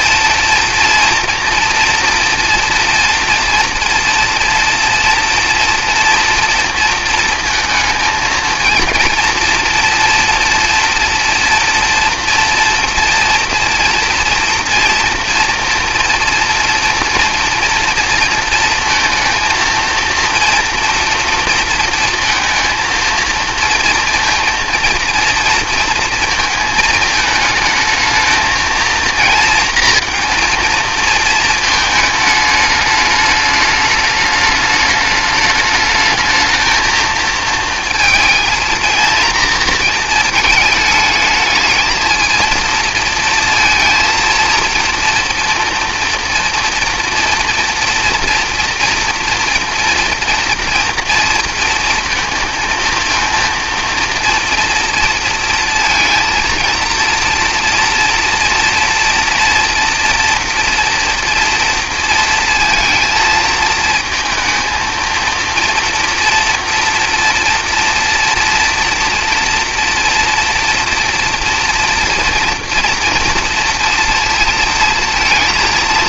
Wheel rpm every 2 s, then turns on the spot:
240, 230, 230, 230, 220, 240, 240, 230, 230, 230, 230, 230, 230, 220, 220, 230, 210, 210, 220, 230, 210, 230, 230, 230, 230, 230, 230, 230, 230, 230, 240, 230, 230, 230, 230, 230, 240, 230.
none